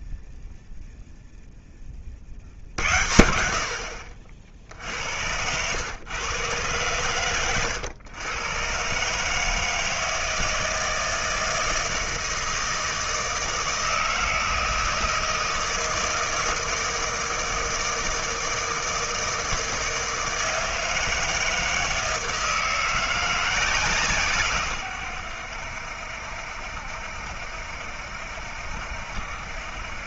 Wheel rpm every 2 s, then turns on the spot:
0, 50, 50, 120, 120, 160, 160, 160, 160, 160, 160, 160, 130, 70, 70.
none